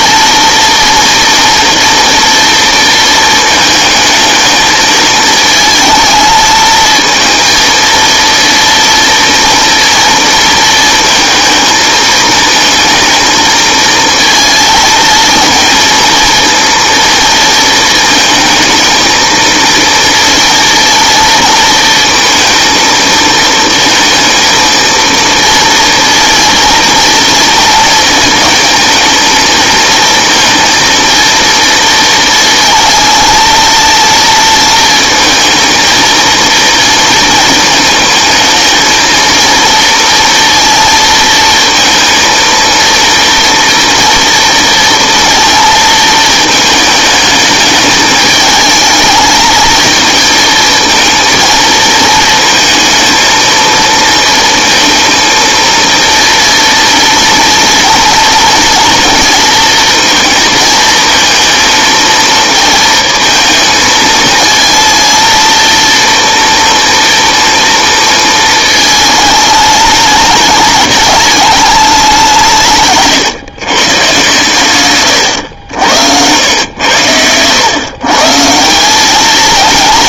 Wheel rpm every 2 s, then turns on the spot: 230, 230, 220, 230, 230, 230, 220, 230, 230, 220, 230, 230, 230, 230, 220, 230, 230, 230, 230, 220, 230, 230, 230, 210, 220, 230, 230, 230, 230, 230, 220, 220, 230, 230, 220, 210, 140, 120, 100, 200.
none